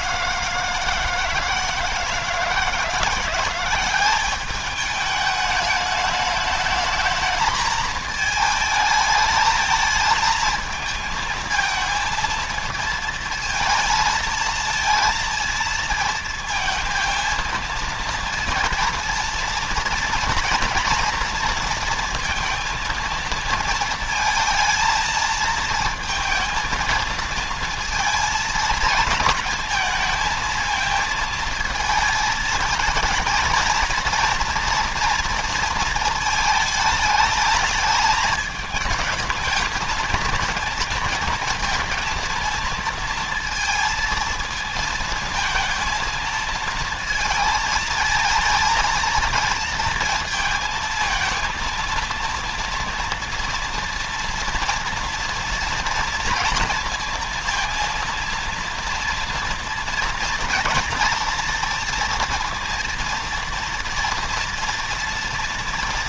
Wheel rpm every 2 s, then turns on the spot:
160, 170, 200, 220, 220, 220, 230, 230, 230, 230, 230, 230, 220, 220, 230, 220, 220, 230, 220, 220, 220, 230, 220, 230, 230, 230, 230, 230, 230, 230, 230, 230, 230.
none